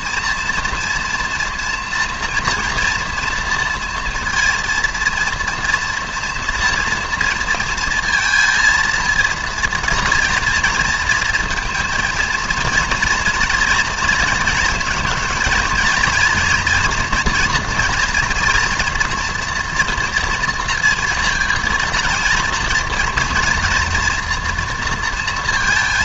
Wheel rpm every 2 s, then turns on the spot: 230, 230, 230, 230, 230, 230, 230, 230, 240, 230, 230, 230, 230.
none